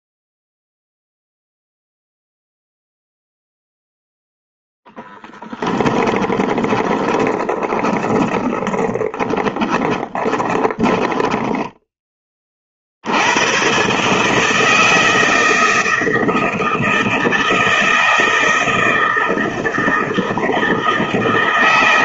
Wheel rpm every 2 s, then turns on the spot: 0, 0, 0, 20, 20, 20, 40, 160, 160, 160, 160.
6-12